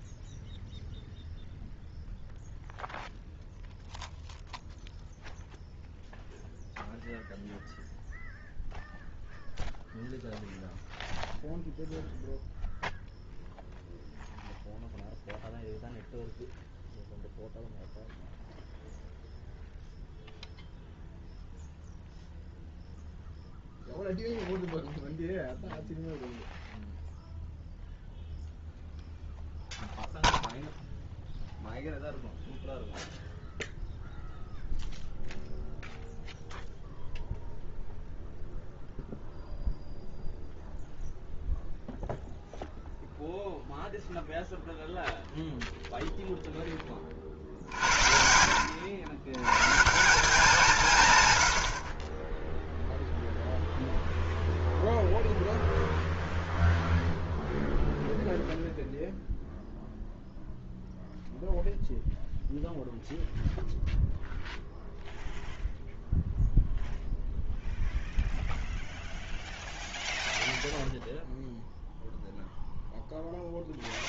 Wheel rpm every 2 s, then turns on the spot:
0, 0, 0, 0, 0, 0, 0, 0, 0, 0, 0, 0, 0, 0, 0, 0, 0, 0, 0, 0, 0, 0, 0, 10, 80, 180, 0, 0, 0, 0, 0, 0, 0, 0, 0, 0, 0.
none